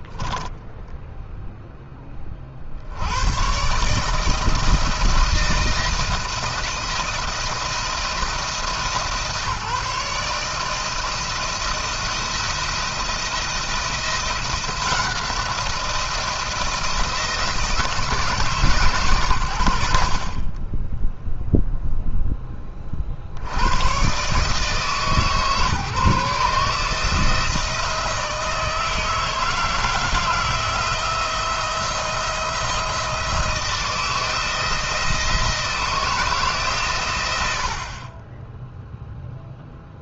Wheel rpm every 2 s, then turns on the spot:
0, 90, 160, 170, 160, 160, 170, 170, 160, 120, 10, 50, 150, 160, 160, 170, 170, 160, 110, 0.
none